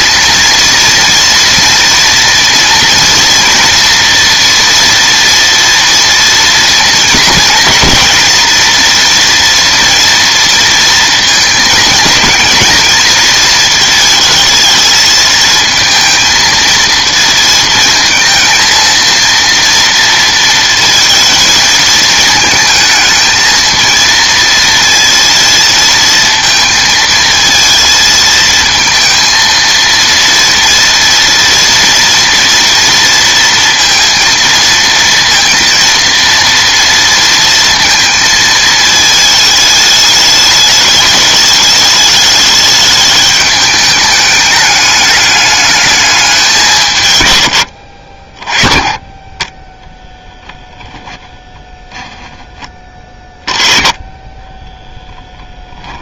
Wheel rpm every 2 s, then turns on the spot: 230, 230, 230, 230, 230, 230, 220, 220, 230, 230, 230, 220, 230, 220, 230, 230, 230, 230, 230, 220, 210, 210, 210, 170, 20, 10, 20, 10.
50-52 54-56